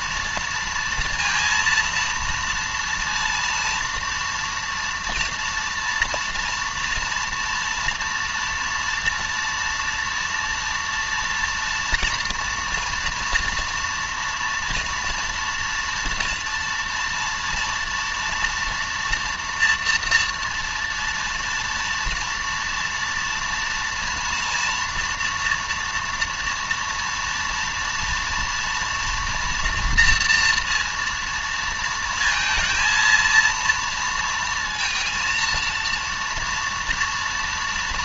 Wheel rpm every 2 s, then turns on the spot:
230, 230, 230, 230, 230, 230, 240, 240, 230, 230, 230, 230, 230, 230, 230, 230, 230, 230, 230.
none